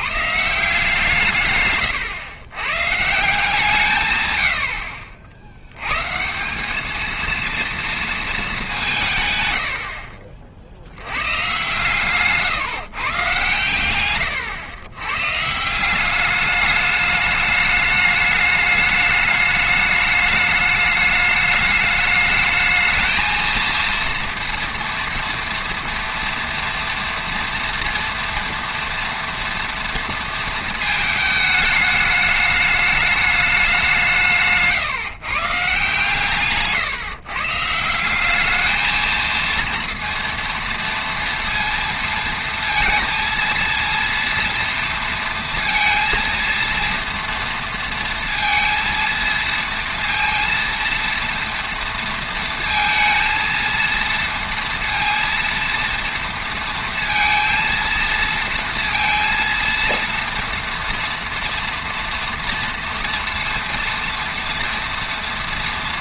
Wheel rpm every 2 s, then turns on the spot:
150, 110, 90, 190, 220, 40, 140, 110, 200, 210, 210, 210, 230, 230, 230, 230, 210, 150, 140, 210, 230, 230, 230, 230, 230, 230, 230, 230, 230, 230, 230, 230, 230.
34-36